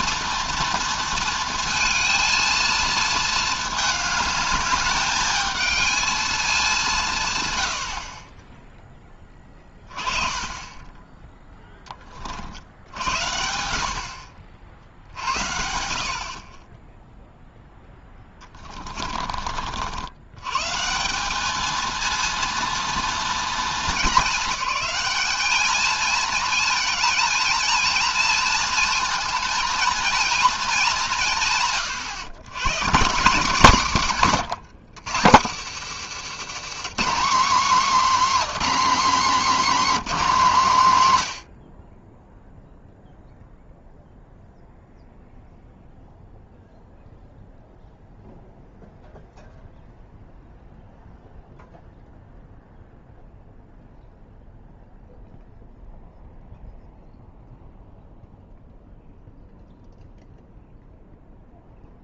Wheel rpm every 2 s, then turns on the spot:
230, 220, 210, 190, 10, 10, 60, 60, 20, 20, 150, 230, 210, 230, 230, 210, 150, 130, 200, 270, 160, 0, 0, 0, 0, 0, 0, 0, 0, 0, 0.
18-20 34-36